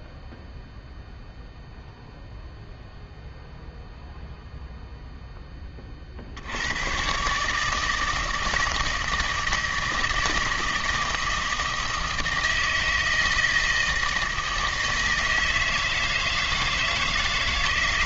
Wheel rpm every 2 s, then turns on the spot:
0, 0, 0, 100, 160, 160, 160, 160, 160.
none